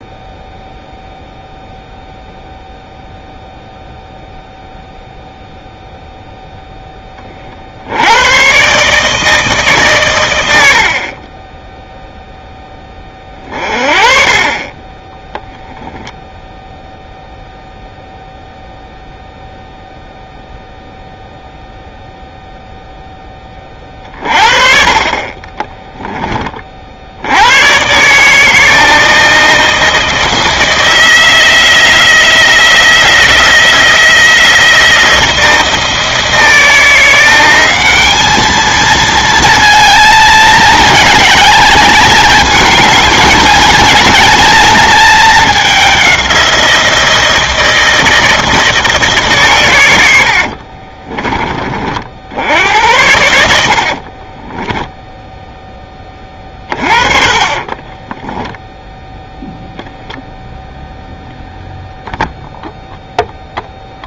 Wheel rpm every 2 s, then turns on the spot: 0, 0, 0, 10, 130, 80, 10, 20, 0, 0, 0, 0, 40, 30, 160, 160, 170, 170, 170, 220, 220, 220, 220, 170, 170, 60, 80, 10, 30, 0, 0, 0.
50-52 54-58